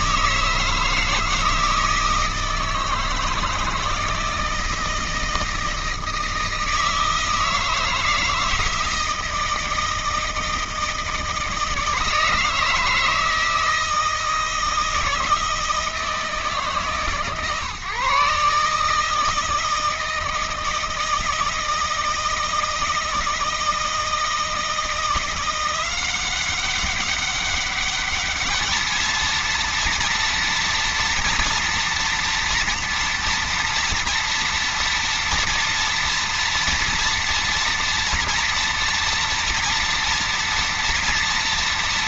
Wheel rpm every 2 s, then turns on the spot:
160, 160, 160, 160, 160, 160, 160, 160, 150, 150, 160, 160, 170, 190, 220, 230, 230, 230, 230, 230, 230.
none